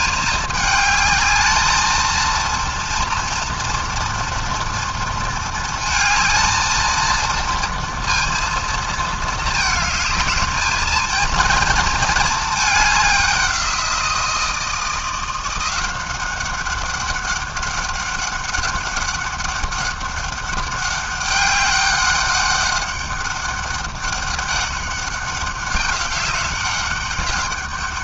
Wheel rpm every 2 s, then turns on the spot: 220, 230, 230, 230, 220, 230, 190, 170, 200, 200, 200, 200, 190, 200.
none